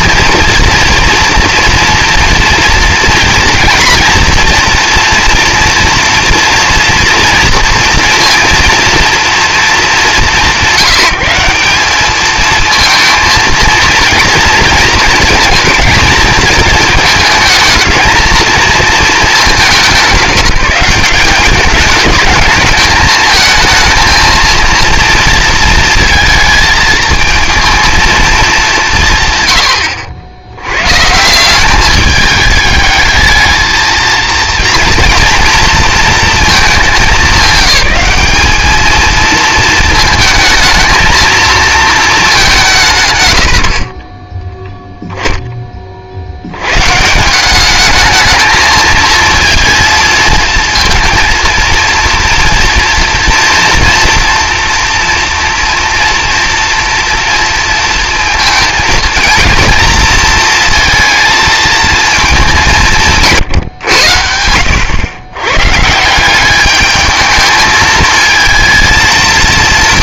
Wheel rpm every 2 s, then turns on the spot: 230, 240, 230, 230, 230, 190, 220, 230, 220, 220, 180, 210, 230, 220, 190, 110, 210, 230, 220, 210, 220, 180, 10, 100, 220, 220, 240, 230, 230, 230, 230, 190, 80, 200, 230.
none